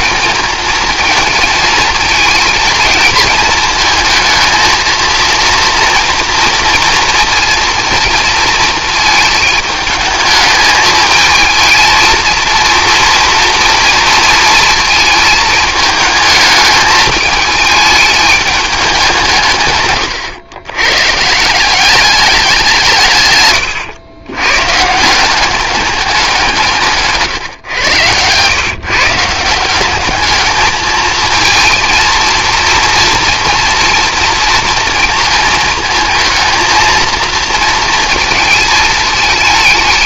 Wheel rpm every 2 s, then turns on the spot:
220, 220, 230, 230, 220, 220, 230, 230, 220, 210, 120, 180, 130, 180, 130, 210, 230, 230, 230, 230.
none